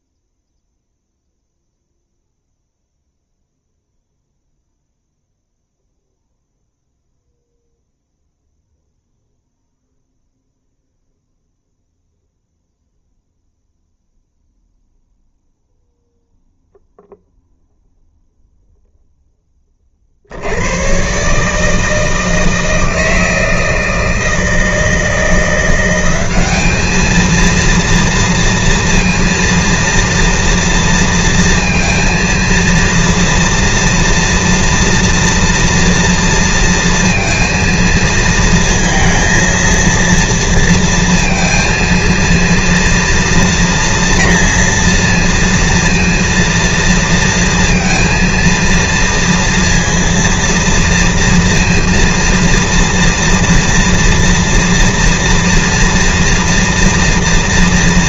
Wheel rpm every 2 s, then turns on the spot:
0, 0, 0, 0, 0, 0, 0, 0, 0, 0, 90, 160, 160, 210, 230, 230, 230, 230, 230, 230, 230, 230, 230, 230, 230, 230, 230, 230, 230.
none